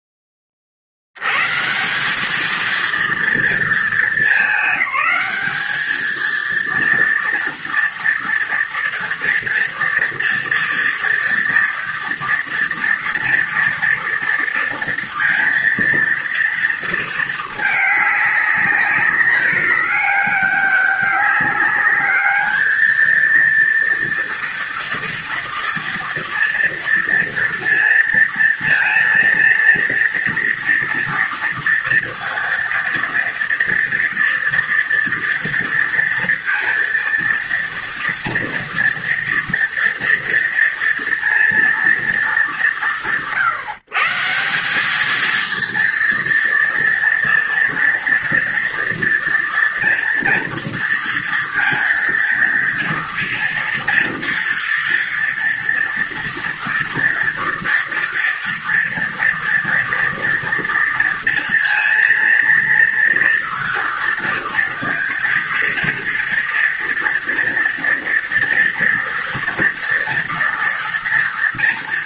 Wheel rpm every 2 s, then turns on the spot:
70, 230, 210, 230, 230, 230, 230, 230, 220, 200, 200, 230, 230, 230, 230, 240, 230, 230, 230, 230, 230, 140, 220, 230, 230, 230, 230, 230, 230, 240, 230, 230, 230, 230, 230, 230.
none